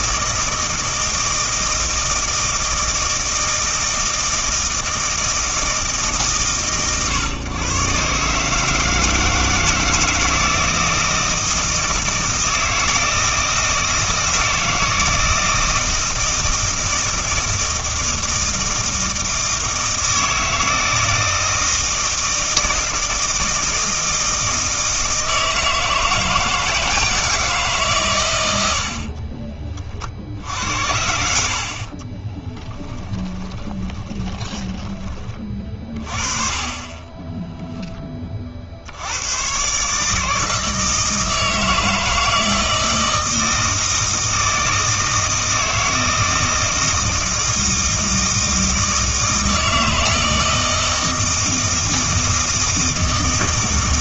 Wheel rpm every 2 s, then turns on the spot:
160, 160, 160, 130, 150, 160, 160, 160, 160, 160, 160, 160, 160, 160, 80, 80, 10, 10, 30, 70, 160, 160, 160, 160, 160, 160, 160.
32-34